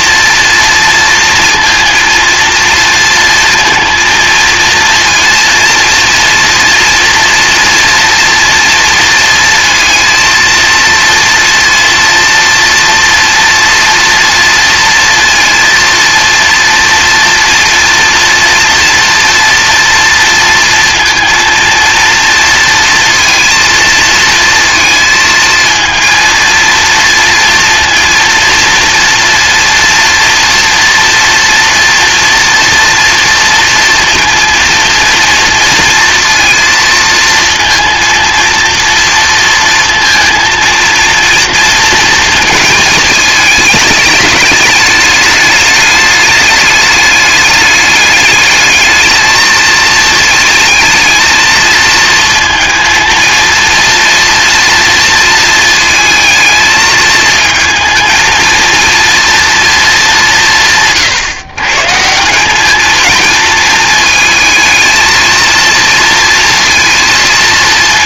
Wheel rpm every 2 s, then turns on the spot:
230, 230, 230, 230, 230, 230, 240, 240, 230, 230, 230, 230, 220, 230, 230, 230, 230, 230, 230, 230, 230, 230, 210, 210, 210, 220, 230, 230, 220, 230, 150, 200, 220, 230.
none